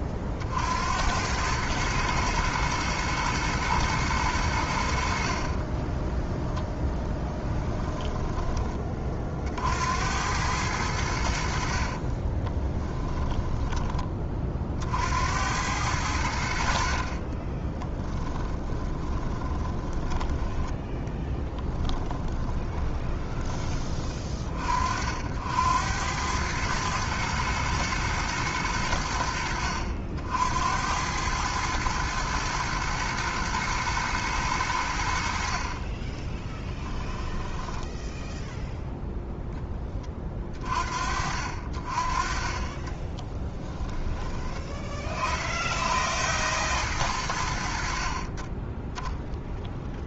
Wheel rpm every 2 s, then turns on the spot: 90, 110, 60, 10, 30, 80, 10, 70, 40, 20, 10, 20, 60, 110, 90, 100, 120, 70, 10, 0, 50, 20, 30, 90, 0.
12-14 16-24 36-38 42-44